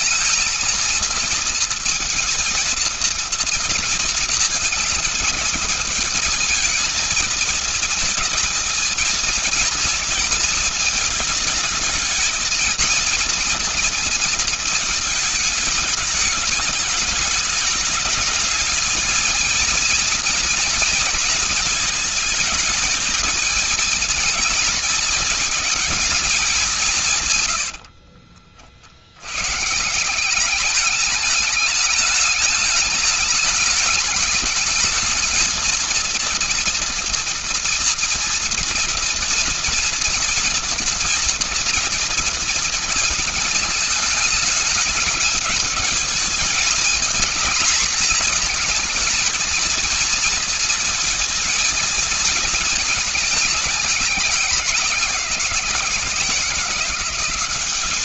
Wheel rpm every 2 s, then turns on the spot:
230, 230, 220, 230, 220, 220, 230, 220, 210, 230, 230, 220, 230, 140, 70, 210, 210, 220, 230, 230, 230, 230, 220, 220, 220, 230, 220, 190, 170.
26-28